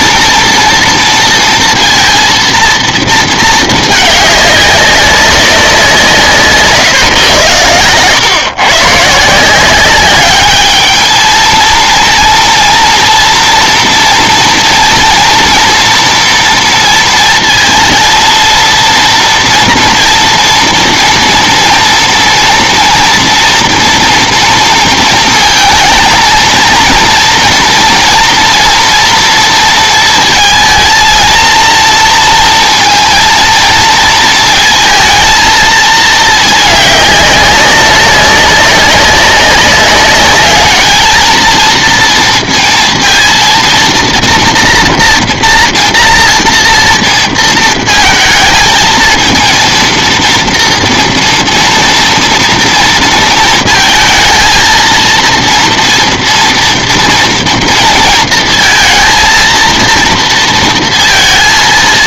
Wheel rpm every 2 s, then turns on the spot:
230, 230, 200, 150, 130, 210, 230, 230, 230, 230, 230, 230, 230, 230, 230, 230, 230, 220, 210, 200, 210, 230, 230, 240, 220, 230, 230, 230, 240, 230, 230.
none